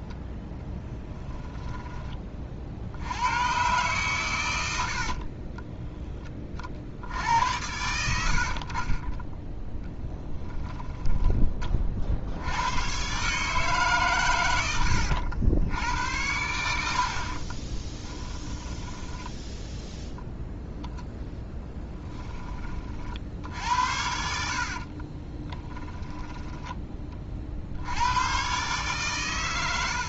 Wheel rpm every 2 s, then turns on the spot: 10, 60, 80, 40, 50, 10, 100, 100, 70, 10, 0, 20, 50, 10, 130.
0-2 10-12 24-26